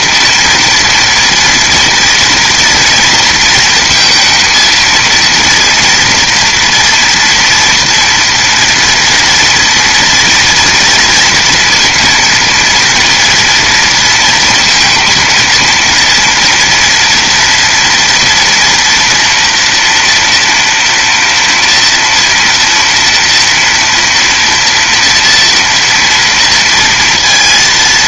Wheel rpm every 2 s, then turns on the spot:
230, 230, 220, 230, 230, 230, 230, 230, 230, 230, 230, 230, 230, 230.
none